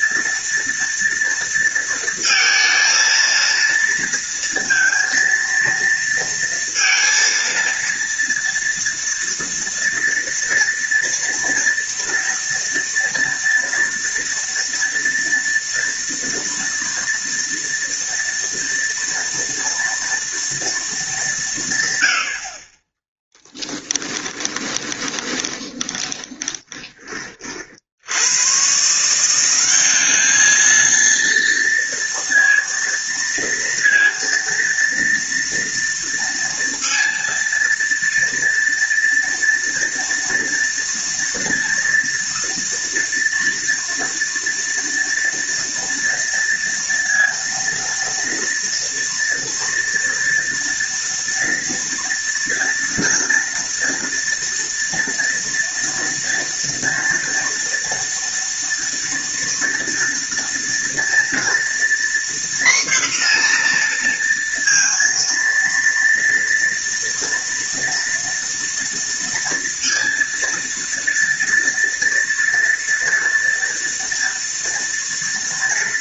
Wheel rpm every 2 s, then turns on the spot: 230, 230, 230, 230, 230, 230, 230, 230, 230, 230, 220, 20, 20, 20, 160, 230, 230, 230, 230, 230, 230, 240, 230, 230, 230, 230, 230, 230, 230, 230, 230, 240, 230, 230, 230, 230, 230, 230.
24-26